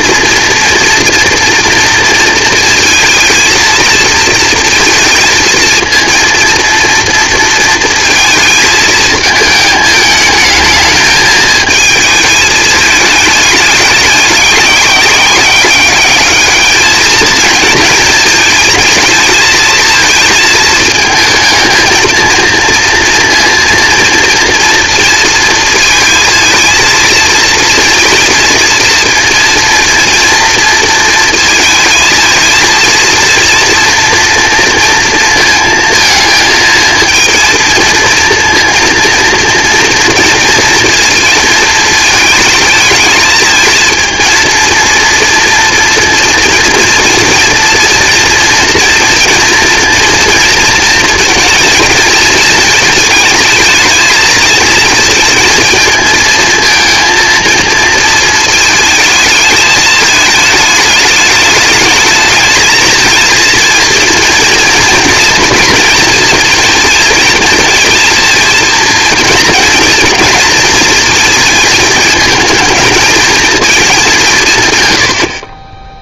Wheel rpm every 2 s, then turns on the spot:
240, 230, 230, 230, 220, 220, 220, 200, 220, 220, 220, 230, 230, 230, 230, 230, 230, 230, 220, 230, 230, 220, 230, 230, 230, 230, 220, 230, 220, 220, 220, 220, 230, 230, 230, 230, 220, 140.
none